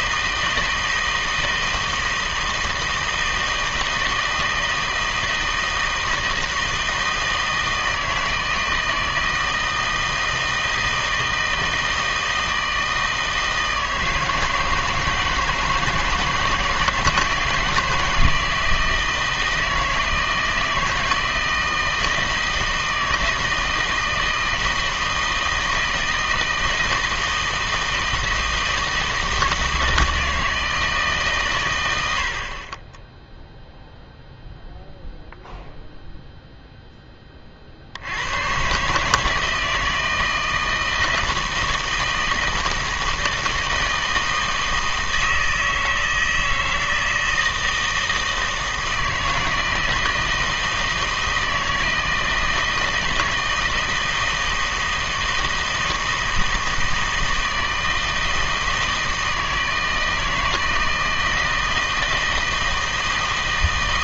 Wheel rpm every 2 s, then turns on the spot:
160, 160, 160, 160, 160, 160, 160, 160, 160, 160, 160, 160, 160, 160, 160, 160, 40, 0, 0, 120, 160, 160, 160, 160, 160, 160, 160, 160, 160, 160, 160, 160.
none